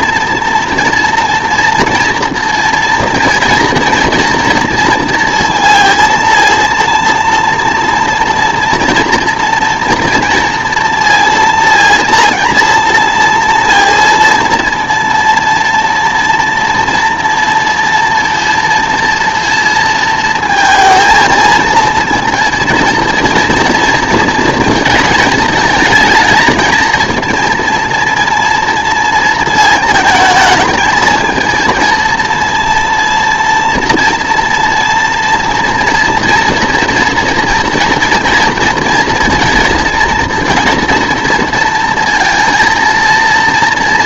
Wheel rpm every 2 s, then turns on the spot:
240, 230, 230, 230, 230, 230, 230, 230, 230, 230, 230, 230, 220, 220, 230, 220, 230, 230, 230, 230, 240, 230.
none